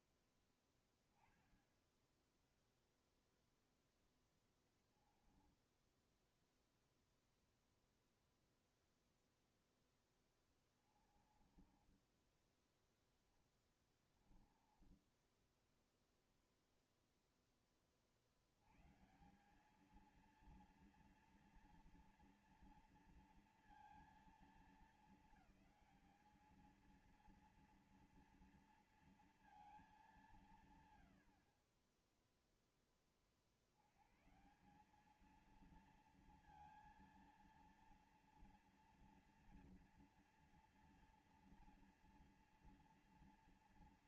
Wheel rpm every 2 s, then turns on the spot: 10, 0, 10, 0, 0, 20, 10, 20, 0, 80, 230, 230, 210, 210, 230, 150, 0, 150, 230, 230, 240, 230.
4-6 10-16